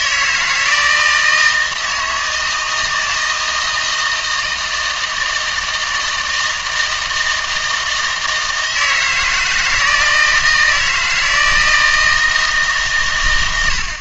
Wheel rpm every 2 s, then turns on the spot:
160, 160, 160, 160, 160, 160, 150.
none